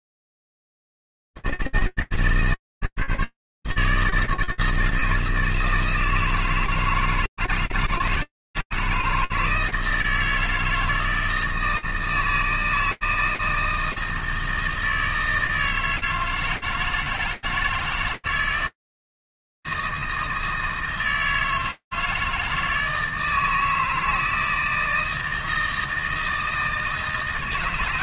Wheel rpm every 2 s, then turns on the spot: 80, 160, 150, 160, 160, 160, 160, 160, 160, 160, 160, 160, 160, 160.
none